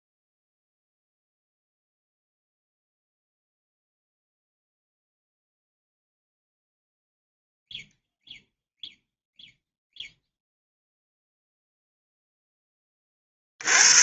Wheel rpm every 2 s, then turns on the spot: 0, 0, 0, 0, 0, 0, 40.
none